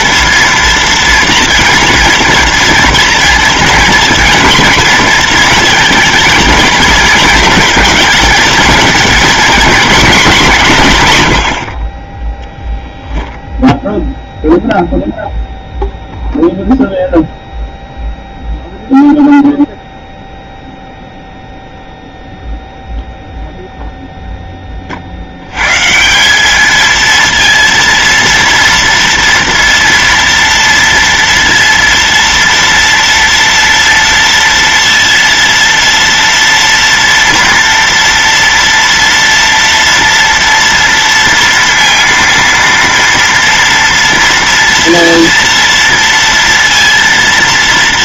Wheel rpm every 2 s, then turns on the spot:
230, 240, 230, 230, 230, 180, 0, 0, 0, 0, 0, 0, 20, 210, 230, 230, 230, 230, 230, 230, 230, 230, 230, 230.
none